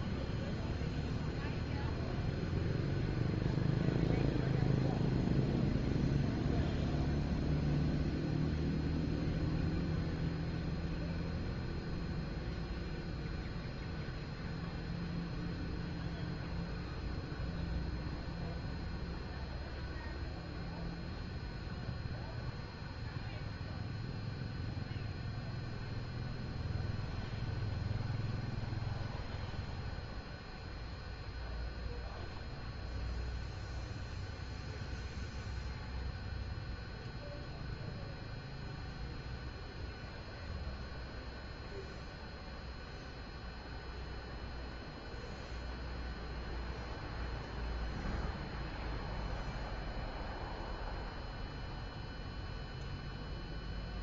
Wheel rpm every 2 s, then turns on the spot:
0, 0, 0, 0, 0, 0, 0, 0, 0, 0, 0, 0, 0, 0, 0, 0, 0, 0, 0, 0, 0, 0, 0, 0, 0, 0, 0.
none